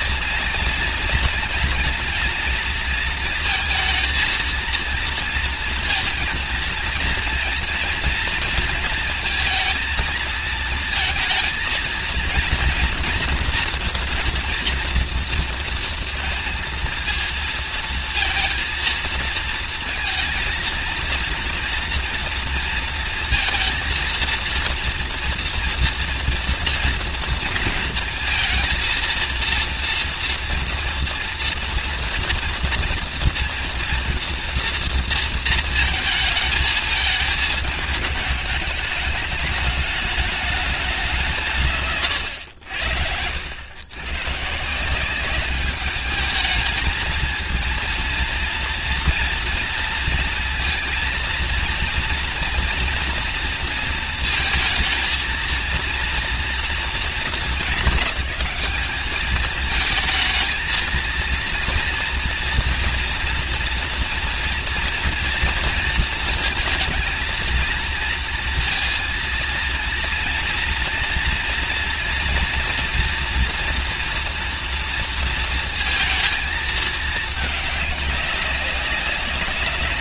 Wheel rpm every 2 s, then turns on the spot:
230, 230, 230, 230, 230, 230, 230, 230, 230, 230, 230, 230, 230, 240, 230, 230, 230, 230, 220, 210, 210, 90, 160, 220, 230, 230, 240, 220, 220, 200, 230, 240, 230, 230, 230, 230, 230, 230, 220, 200.
none